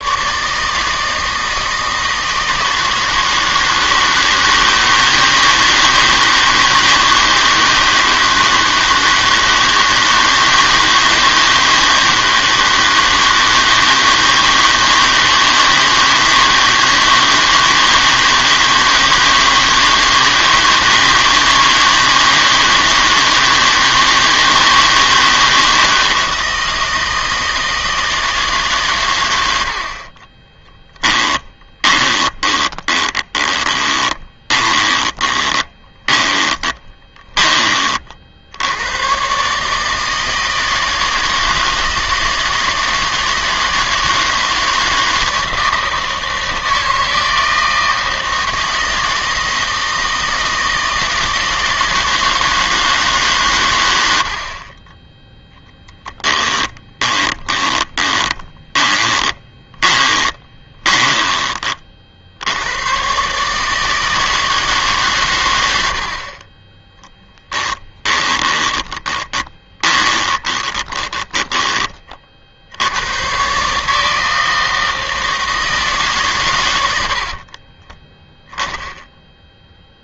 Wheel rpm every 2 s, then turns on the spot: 160, 160, 160, 160, 160, 160, 160, 160, 170, 160, 160, 160, 160, 160, 140, 10, 20, 20, 20, 100, 160, 160, 160, 160, 160, 160, 160, 20, 20, 20, 20, 100, 140, 10, 20, 20, 80, 160, 90, 10.
30-38 56-62 68-72